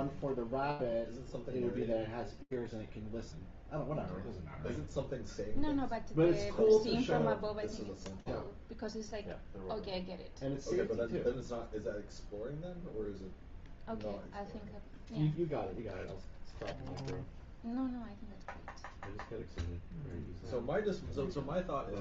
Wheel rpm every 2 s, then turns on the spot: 0, 0, 0, 0, 0, 0, 0, 0, 0, 0, 0.
none